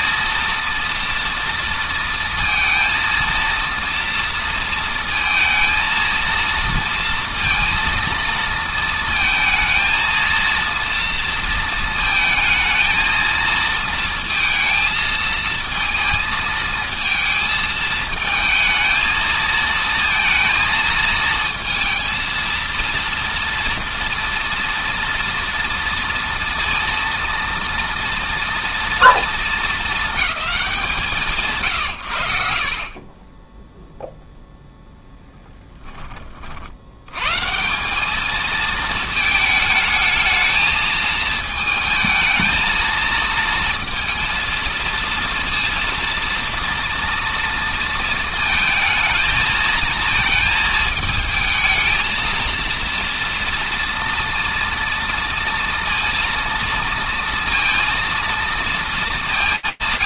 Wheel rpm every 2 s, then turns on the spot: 230, 230, 230, 230, 230, 230, 220, 220, 220, 220, 220, 230, 230, 230, 230, 140, 20, 0, 90, 230, 220, 220, 230, 230, 230, 220, 230, 230, 230, 220.
none